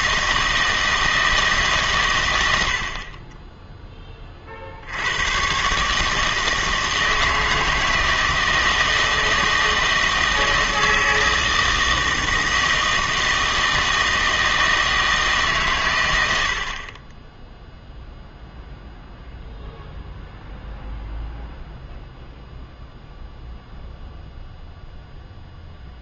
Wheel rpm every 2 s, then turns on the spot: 160, 80, 50, 160, 160, 160, 160, 160, 60, 0, 0, 0, 0.
none